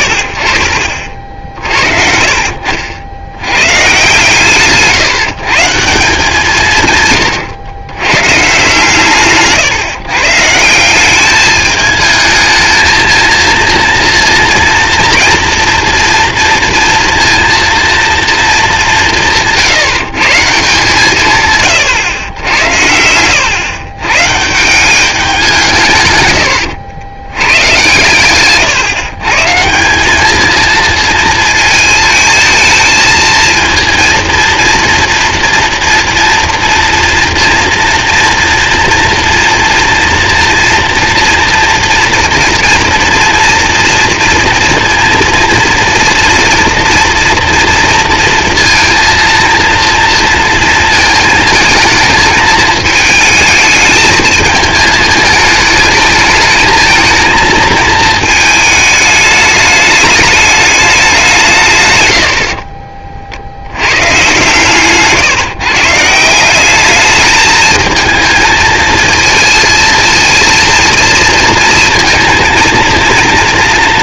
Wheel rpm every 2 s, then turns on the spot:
60, 60, 140, 160, 140, 160, 220, 230, 230, 210, 160, 90, 150, 110, 120, 220, 220, 230, 230, 230, 230, 230, 230, 230, 230, 230, 220, 220, 220, 220, 210, 60, 130, 180, 220, 230, 230.
26-28 62-64